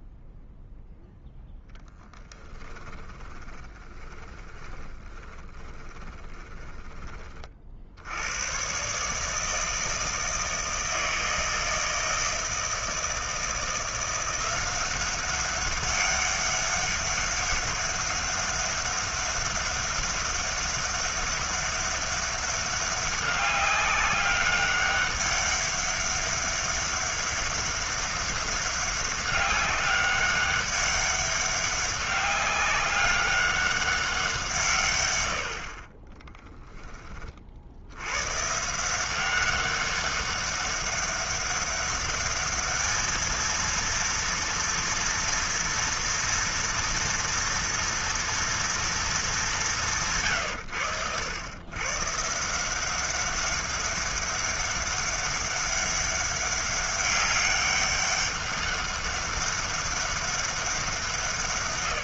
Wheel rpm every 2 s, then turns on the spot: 0, 10, 20, 20, 100, 160, 160, 180, 200, 200, 200, 200, 200, 200, 200, 200, 200, 170, 10, 130, 200, 210, 230, 230, 230, 130, 160, 200, 200, 200, 200.
2-8